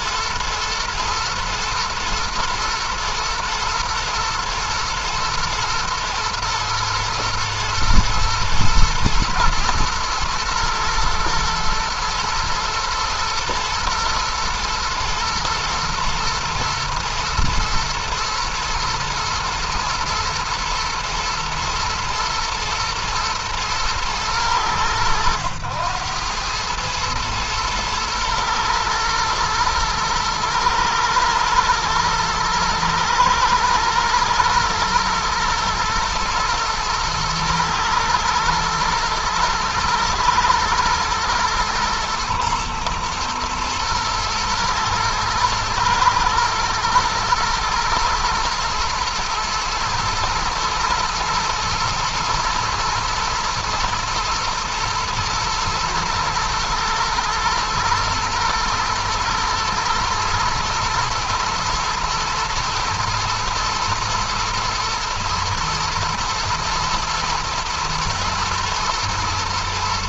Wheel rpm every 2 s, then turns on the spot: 110, 120, 120, 110, 110, 110, 110, 110, 110, 110, 120, 110, 90, 110, 120, 120, 120, 110, 110, 110, 110, 120, 110, 120, 120, 120, 110, 110, 110, 120, 120, 110, 110, 110, 110.
none